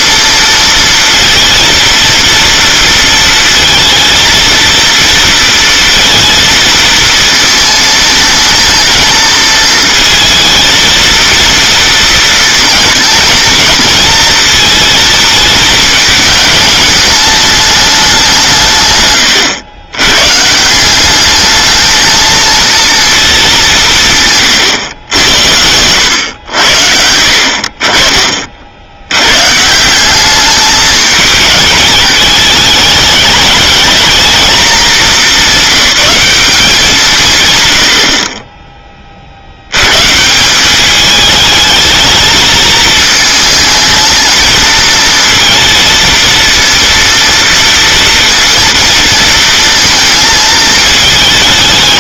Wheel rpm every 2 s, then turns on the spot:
230, 230, 230, 230, 220, 230, 220, 230, 210, 140, 170, 230, 130, 90, 50, 210, 220, 220, 190, 20, 190, 220, 220, 230, 230, 220.
none